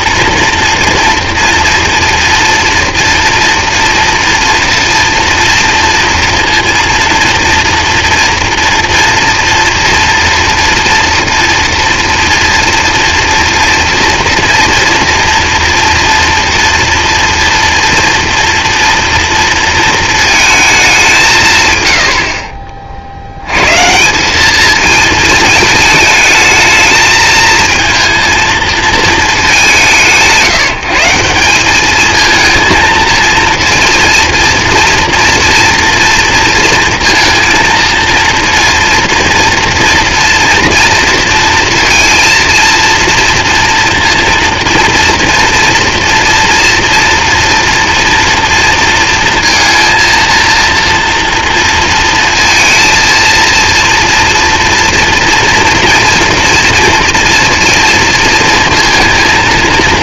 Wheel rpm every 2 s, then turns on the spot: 230, 230, 230, 230, 230, 230, 230, 230, 230, 230, 210, 40, 210, 220, 220, 160, 230, 230, 230, 230, 230, 230, 240, 240, 230, 230, 230, 230, 230, 230.
none